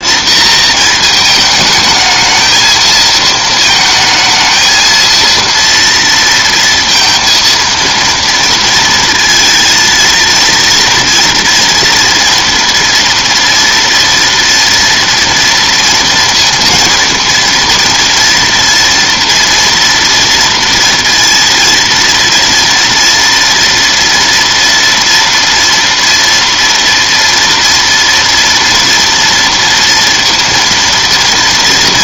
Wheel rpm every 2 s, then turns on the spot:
230, 220, 220, 230, 230, 230, 230, 240, 230, 230, 230, 230, 230, 240, 230, 230.
none